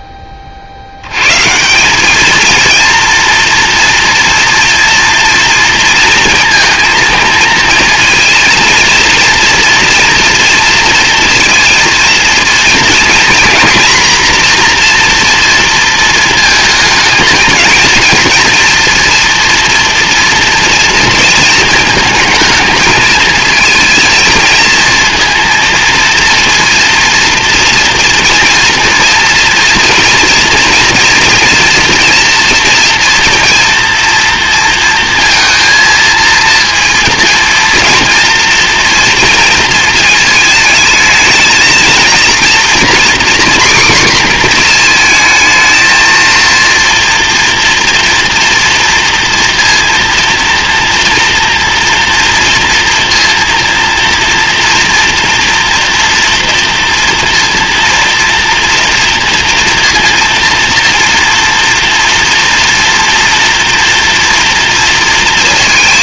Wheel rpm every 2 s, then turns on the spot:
50, 230, 240, 230, 230, 230, 230, 240, 220, 230, 230, 220, 230, 230, 230, 240, 230, 230, 230, 230, 220, 240, 240, 230, 230, 230, 230, 240, 230, 240, 230, 230, 230.
none